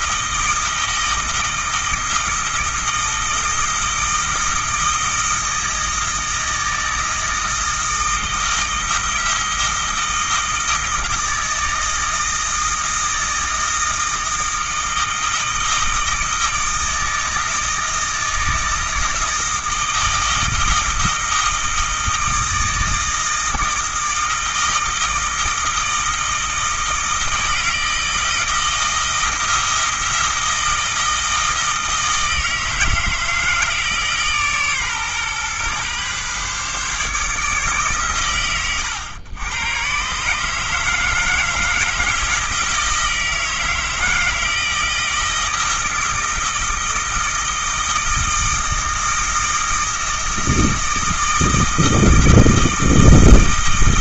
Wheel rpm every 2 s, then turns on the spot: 160, 160, 160, 160, 160, 160, 160, 160, 160, 160, 160, 160, 160, 160, 170, 160, 160, 140, 140, 110, 160, 160, 160, 160, 160, 160, 160.
none